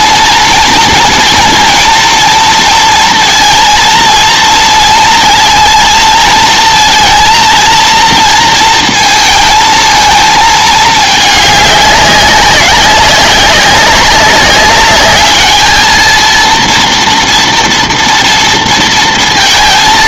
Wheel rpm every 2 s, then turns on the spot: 240, 230, 230, 220, 230, 220, 190, 200, 230, 230.
none